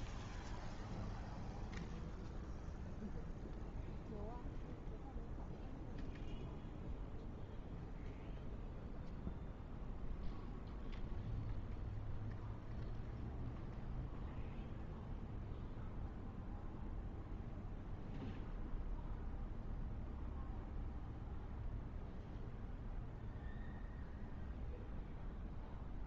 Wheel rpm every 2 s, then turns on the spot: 0, 0, 0, 0, 0, 0, 0, 0, 0, 0, 0, 0, 0.
none